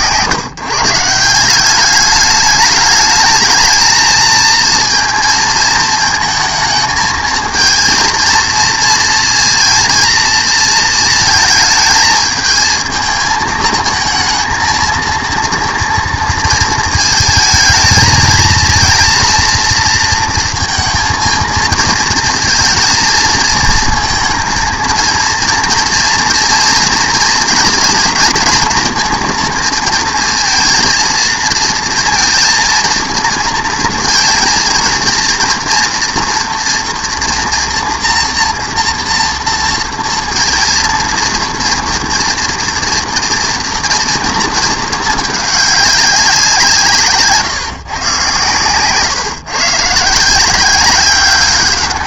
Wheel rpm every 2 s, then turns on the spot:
160, 210, 230, 220, 230, 230, 220, 220, 230, 220, 230, 220, 230, 230, 230, 230, 230, 230, 230, 230, 230, 230, 220, 170, 130, 180.
none